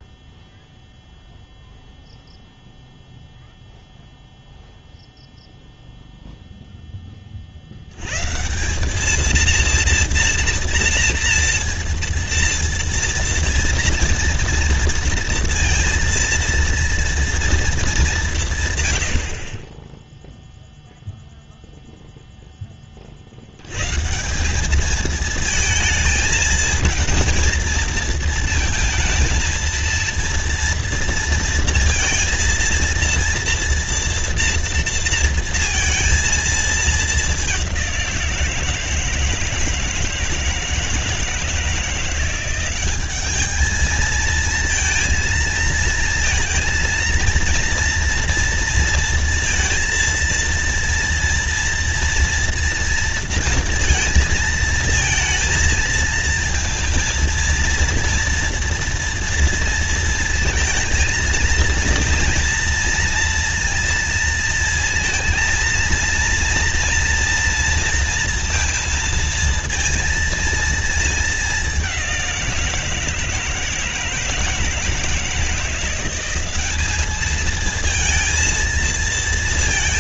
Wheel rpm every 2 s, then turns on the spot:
0, 0, 0, 0, 170, 240, 230, 230, 230, 150, 0, 10, 200, 220, 220, 230, 230, 230, 220, 170, 160, 190, 230, 230, 230, 230, 230, 230, 230, 230, 220, 230, 230, 230, 230, 230, 170, 160, 190, 220.
none